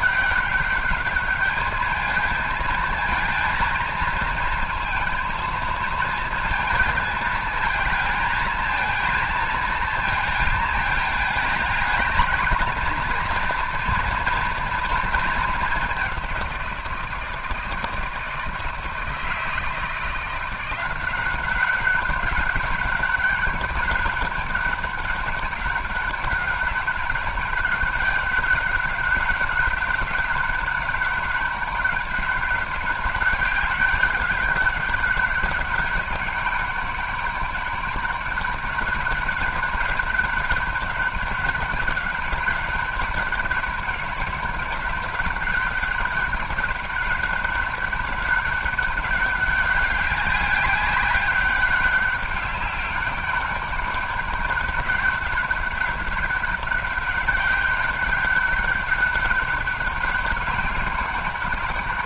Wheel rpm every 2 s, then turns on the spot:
210, 230, 230, 220, 230, 220, 240, 220, 170, 160, 180, 190, 200, 200, 200, 200, 200, 200, 200, 200, 200, 200, 200, 200, 200, 190, 200, 200, 200, 200, 200.
none